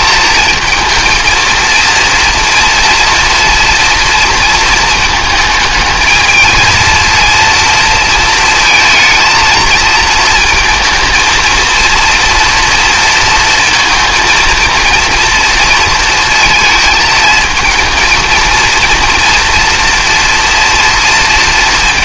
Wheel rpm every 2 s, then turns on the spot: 230, 230, 230, 230, 230, 220, 230, 230, 220, 230, 230.
none